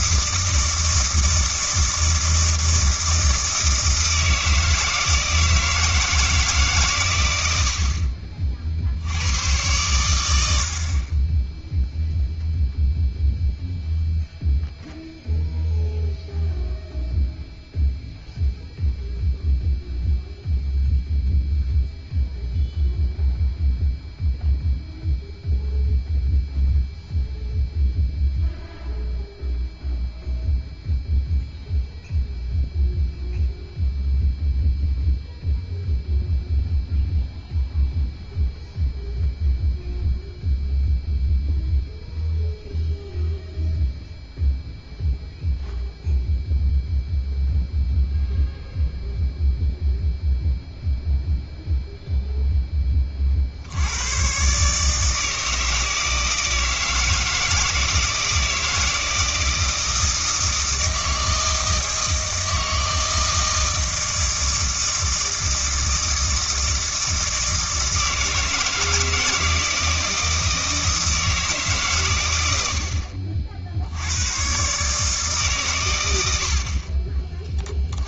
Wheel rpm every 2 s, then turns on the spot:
160, 160, 160, 150, 50, 70, 0, 0, 0, 0, 0, 0, 0, 0, 0, 0, 0, 0, 0, 0, 0, 0, 0, 0, 0, 0, 10, 130, 160, 160, 160, 160, 160, 160, 160, 160, 80, 120, 60.
none